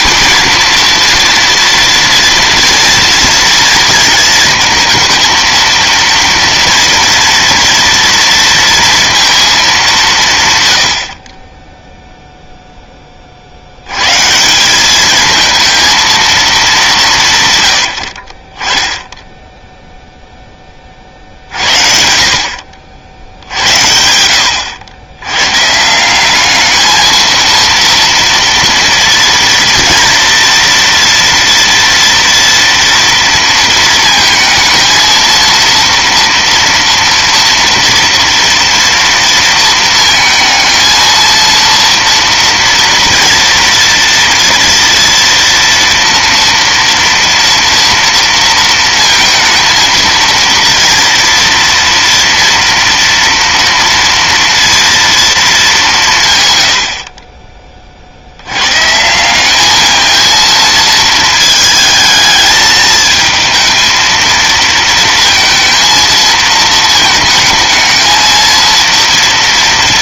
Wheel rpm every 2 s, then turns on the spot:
230, 230, 230, 230, 230, 110, 0, 170, 220, 30, 20, 50, 60, 200, 230, 230, 230, 220, 230, 230, 230, 230, 230, 230, 230, 230, 240, 230, 90, 110, 230, 220, 230, 220, 230.
none